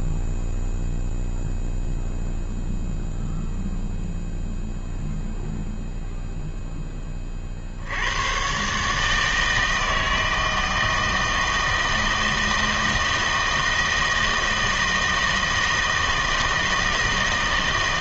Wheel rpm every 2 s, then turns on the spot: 0, 0, 0, 0, 110, 160, 160, 160, 160.
none